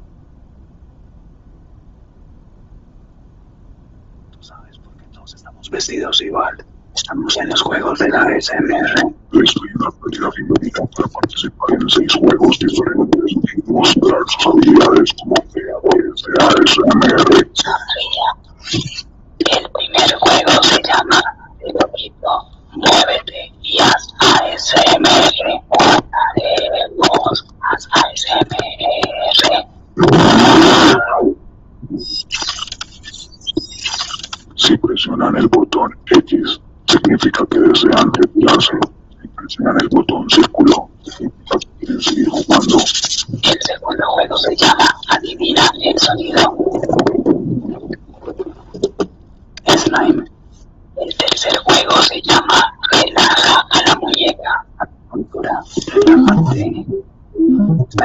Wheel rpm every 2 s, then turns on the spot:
0, 0, 0, 0, 0, 0, 0, 0, 0, 0, 0, 0, 0, 0, 0, 0, 0, 0, 0, 0, 0, 0, 0, 0, 0, 0, 0, 0, 0.
none